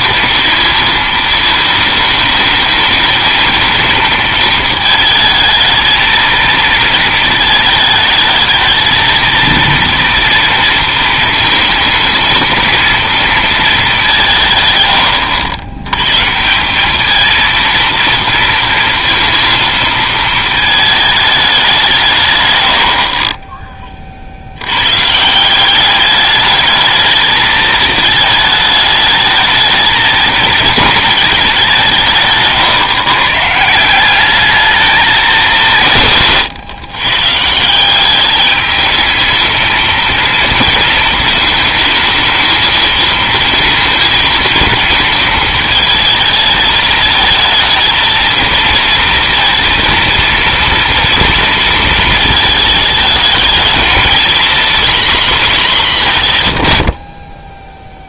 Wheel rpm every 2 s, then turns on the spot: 230, 220, 220, 230, 220, 230, 230, 130, 170, 230, 230, 120, 70, 210, 220, 220, 140, 210, 150, 210, 230, 220, 220, 220, 230, 230, 220, 230, 90.
none